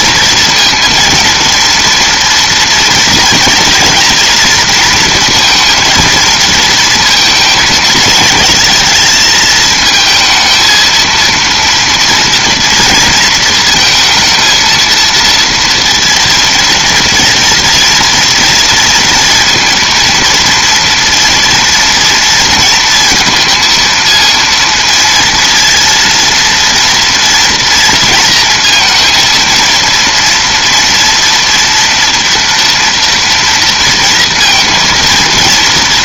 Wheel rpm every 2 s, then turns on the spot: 230, 230, 230, 220, 220, 230, 230, 230, 230, 230, 230, 230, 230, 230, 230, 230, 230, 230.
none